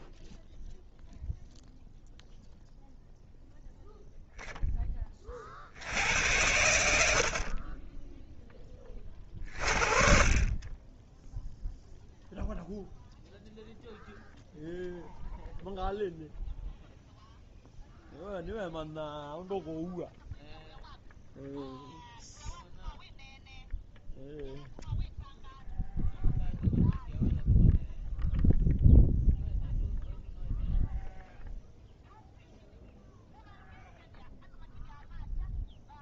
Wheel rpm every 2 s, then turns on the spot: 0, 0, 20, 70, 30, 10, 0, 0, 0, 0, 0, 0, 0, 0, 0, 0, 0, 0.
none